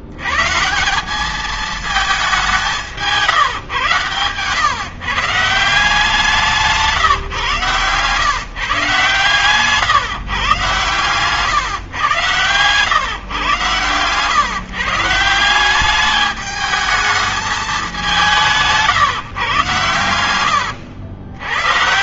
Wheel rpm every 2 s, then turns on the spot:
130, 200, 120, 180, 140, 140, 120, 140, 210, 180, 100.
none